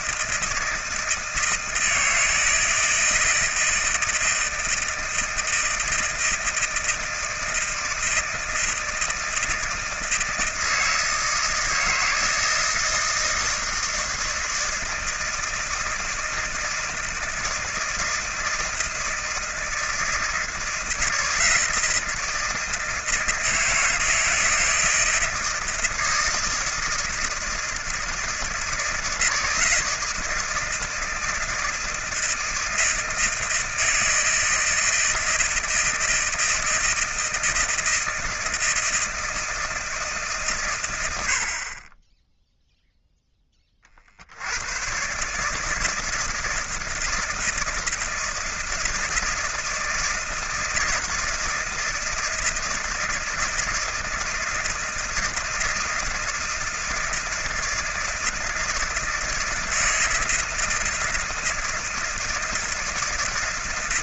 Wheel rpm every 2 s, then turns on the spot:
160, 160, 160, 160, 160, 160, 160, 160, 160, 160, 160, 160, 160, 160, 160, 160, 160, 160, 160, 160, 130, 0, 90, 160, 160, 160, 160, 160, 160, 160, 160, 160.
none